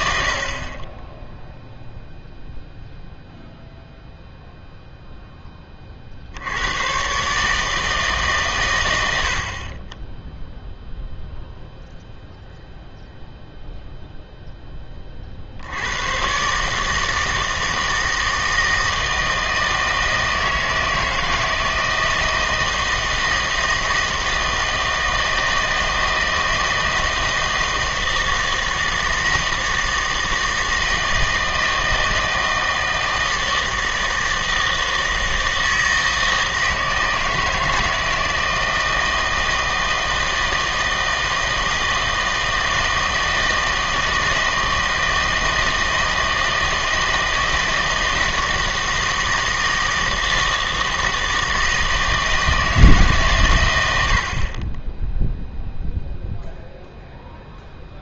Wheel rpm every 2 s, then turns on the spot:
40, 0, 0, 100, 120, 0, 0, 10, 150, 160, 160, 160, 160, 160, 160, 160, 160, 160, 160, 160, 160, 160, 160, 160, 160, 160, 160, 30, 0.
none